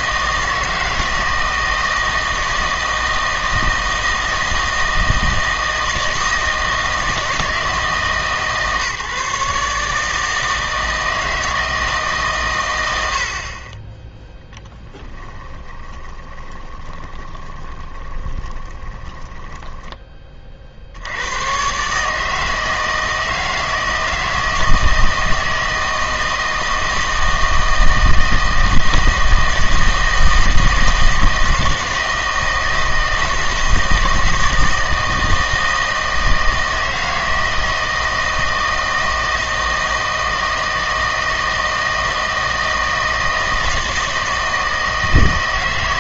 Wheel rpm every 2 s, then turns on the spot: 160, 160, 160, 160, 130, 160, 100, 10, 20, 20, 70, 160, 160, 160, 160, 160, 160, 160, 160, 160, 160, 160, 160.
14-20